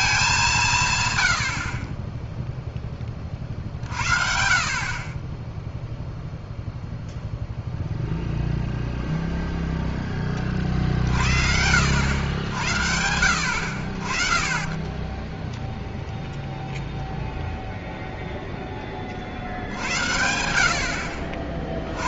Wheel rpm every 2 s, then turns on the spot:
170, 0, 50, 0, 0, 40, 90, 20, 0, 0, 70.
none